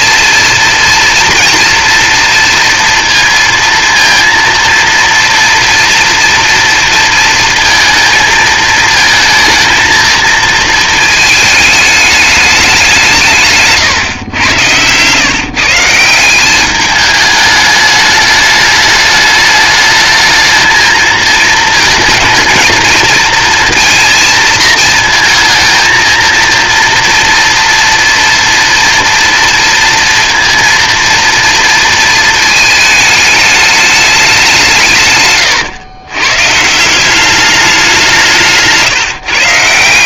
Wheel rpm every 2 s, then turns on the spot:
230, 230, 230, 230, 220, 230, 200, 120, 190, 210, 220, 220, 230, 230, 230, 230, 220, 180, 160, 160.
14-16